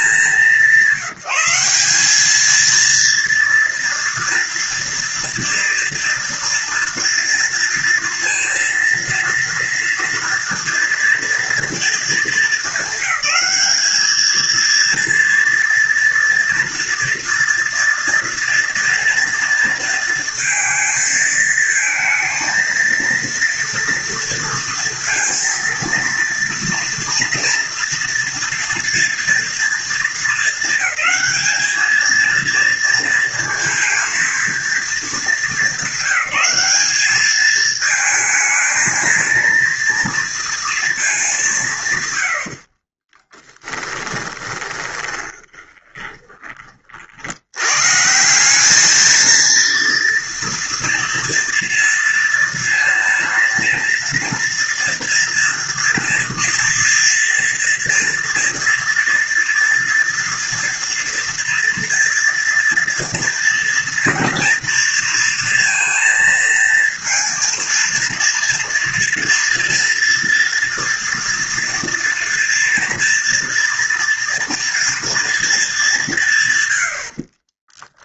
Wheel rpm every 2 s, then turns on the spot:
180, 230, 230, 230, 240, 230, 210, 230, 240, 230, 220, 230, 230, 230, 230, 220, 230, 220, 210, 230, 210, 30, 20, 50, 220, 230, 230, 230, 230, 230, 230, 230, 230, 230, 230, 230, 230, 230, 80.
42-46